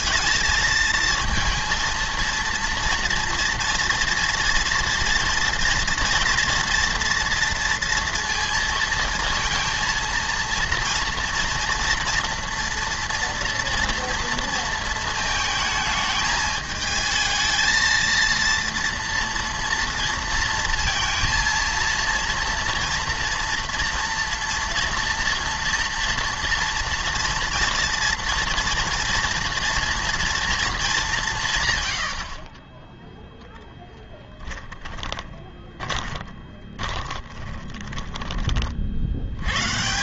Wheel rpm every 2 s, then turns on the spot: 220, 230, 230, 240, 230, 230, 230, 230, 220, 230, 230, 230, 230, 230, 230, 220, 20, 10, 30, 40.
34-38